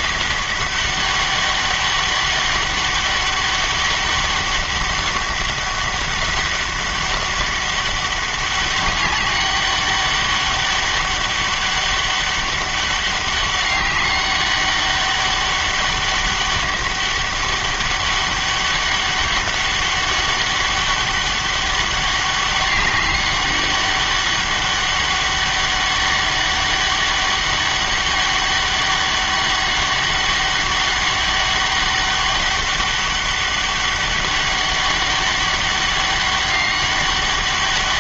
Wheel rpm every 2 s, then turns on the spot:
200, 200, 200, 200, 200, 200, 200, 200, 200, 200, 200, 190, 200, 200, 200, 200, 200, 200, 200.
none